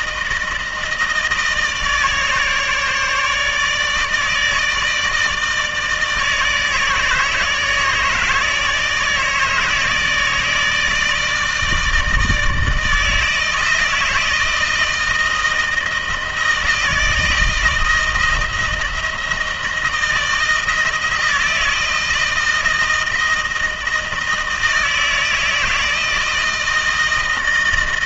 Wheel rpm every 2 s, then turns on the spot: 160, 150, 160, 160, 160, 160, 160, 160, 170, 160, 160, 160, 160, 160.
none